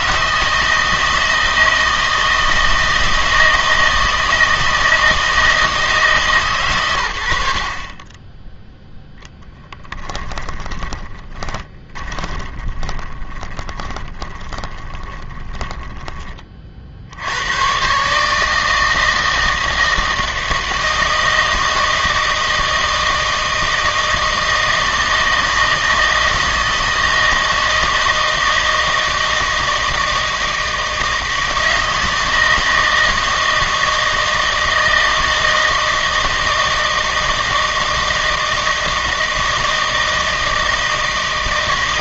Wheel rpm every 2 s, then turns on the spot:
160, 160, 160, 130, 0, 20, 20, 20, 40, 160, 160, 160, 160, 160, 160, 160, 160, 160, 160, 160, 160.
10-16